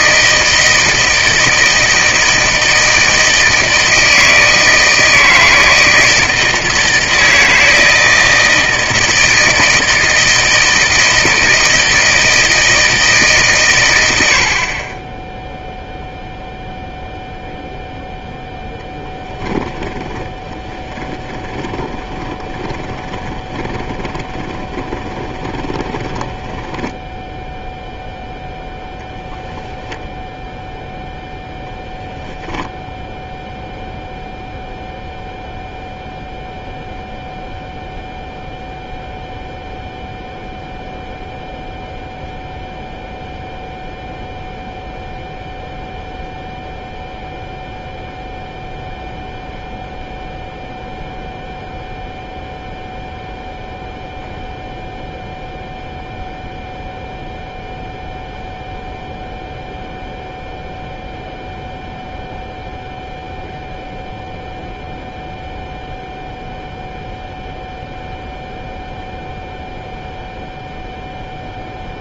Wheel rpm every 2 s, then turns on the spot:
160, 160, 160, 160, 160, 160, 160, 40, 0, 0, 20, 20, 20, 10, 0, 0, 0, 0, 0, 0, 0, 0, 0, 0, 0, 0, 0, 0, 0, 0, 0, 0, 0, 0, 0, 0.
20-28